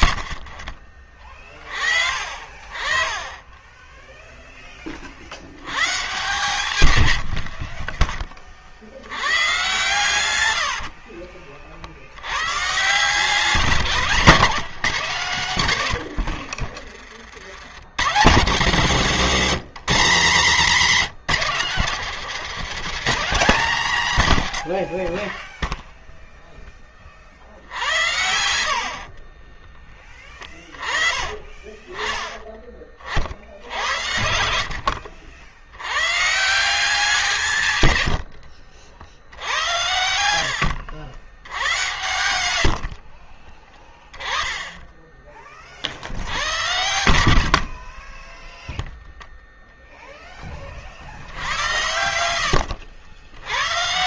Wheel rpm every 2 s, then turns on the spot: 30, 30, 40, 90, 90, 70, 150, 170, 60, 100, 130, 170, 50, 40, 50, 20, 40, 70, 170, 70, 80, 50, 20, 80, 0, 50, 70.
0-2 6-8 10-12 28-30 42-44